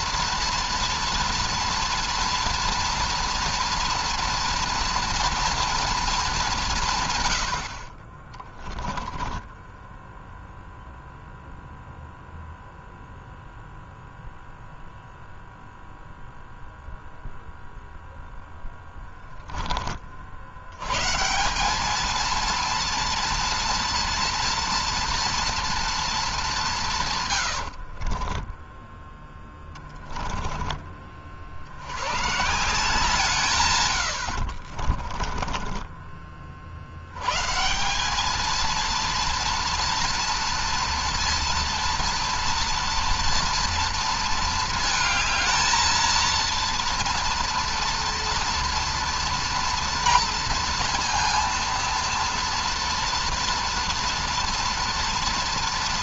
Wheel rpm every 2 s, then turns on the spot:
230, 230, 230, 200, 30, 0, 0, 0, 0, 0, 80, 230, 230, 200, 20, 10, 130, 70, 40, 220, 230, 230, 230, 230, 230, 230, 230, 230.
8-10 28-30 34-36